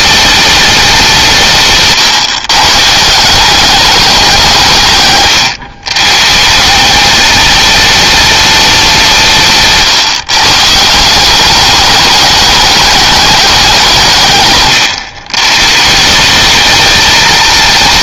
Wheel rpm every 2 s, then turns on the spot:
190, 150, 150, 200, 190, 160, 210, 140, 220.
none